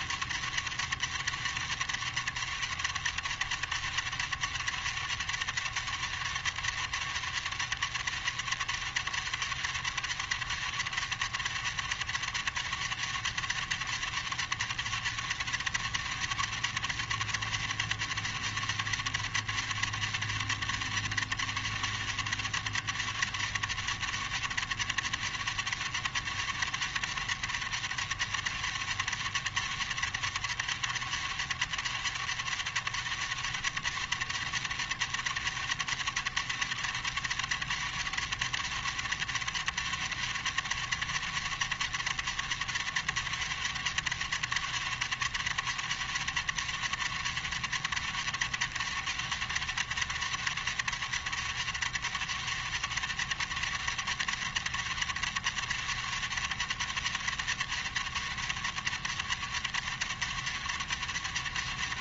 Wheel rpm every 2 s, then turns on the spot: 130, 130, 130, 130, 130, 130, 130, 130, 130, 130, 130, 130, 130, 130, 130, 130, 130, 130, 130, 130, 130, 130, 130, 130, 130, 130, 130, 130, 130, 130, 130.
none